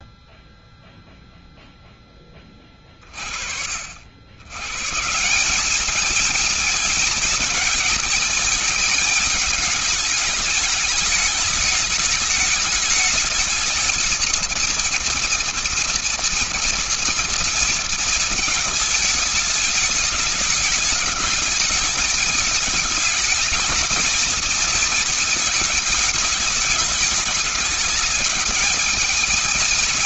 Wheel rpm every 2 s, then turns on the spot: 0, 10, 80, 220, 220, 220, 210, 220, 230, 230, 210, 210, 220, 220, 210.
none